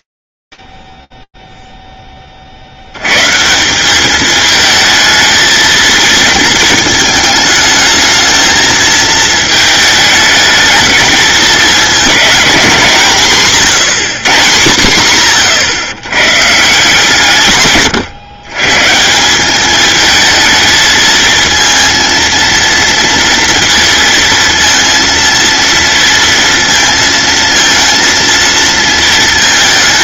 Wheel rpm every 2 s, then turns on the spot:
50, 60, 220, 220, 220, 220, 200, 160, 140, 130, 220, 230, 230, 230, 230.
none